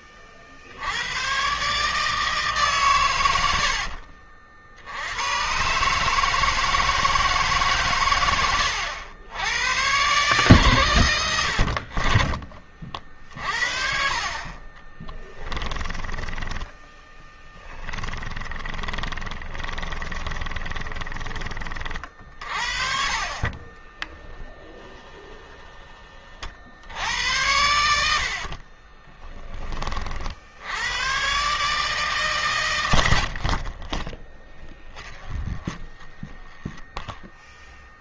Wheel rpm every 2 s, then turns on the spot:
110, 100, 100, 150, 100, 90, 50, 20, 10, 20, 20, 40, 10, 80, 30, 100, 80, 10, 0.
2-4 14-24 28-30 32-36